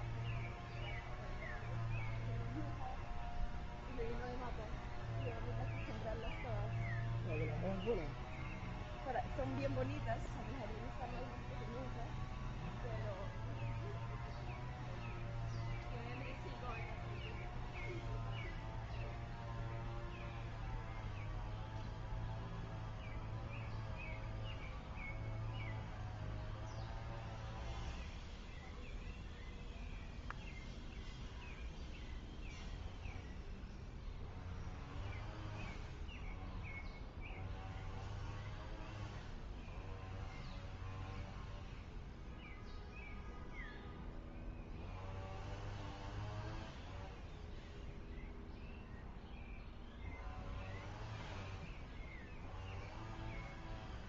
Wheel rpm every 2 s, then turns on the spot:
0, 0, 0, 0, 0, 0, 0, 0, 0, 0, 0, 0, 0, 0, 0, 0, 0, 0, 0, 0, 0, 0, 0, 0, 0, 0, 0.
none